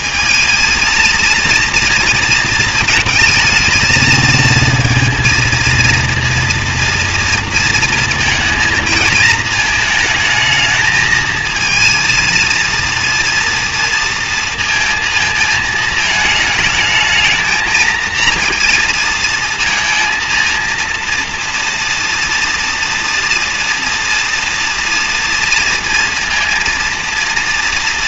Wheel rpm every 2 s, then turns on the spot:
220, 220, 230, 230, 230, 220, 230, 230, 220, 230, 230, 230, 230, 230.
none